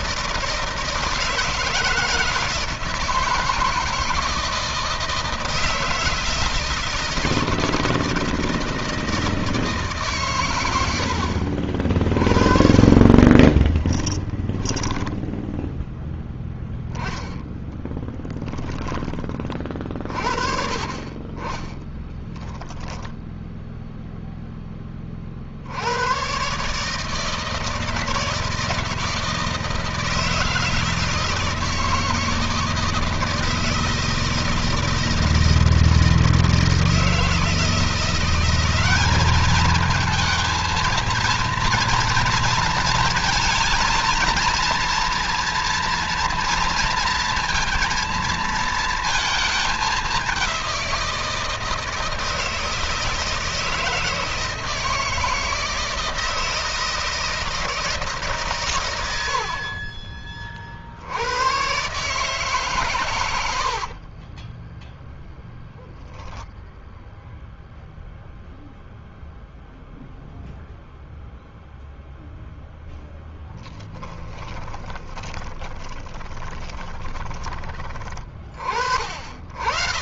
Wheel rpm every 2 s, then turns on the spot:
170, 160, 160, 160, 160, 130, 40, 10, 10, 10, 40, 10, 0, 120, 160, 160, 160, 160, 160, 180, 220, 230, 230, 230, 230, 200, 160, 160, 160, 160, 50, 140, 30, 0, 0, 0, 0, 20, 20, 30.
12-16 22-24 64-66 74-78